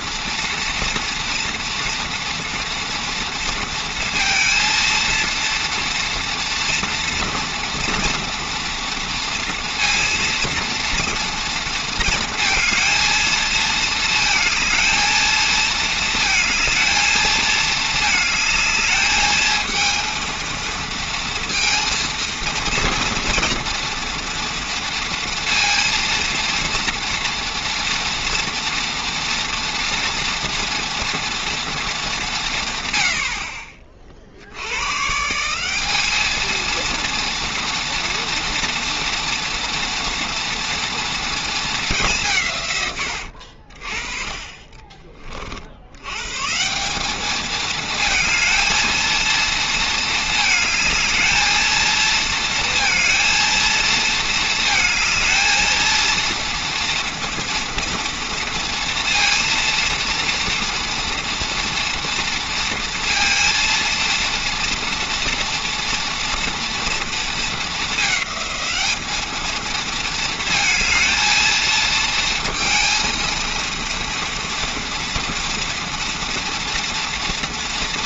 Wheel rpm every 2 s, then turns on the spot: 230, 230, 230, 230, 230, 230, 230, 220, 220, 210, 230, 230, 230, 230, 230, 230, 120, 100, 230, 230, 230, 120, 30, 170, 230, 220, 230, 220, 230, 230, 230, 230, 230, 230, 210, 220, 230, 230, 240.
44-46